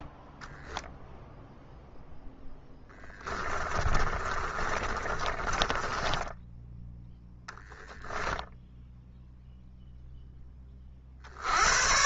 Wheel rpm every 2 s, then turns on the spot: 0, 10, 30, 10, 0, 30.
2-6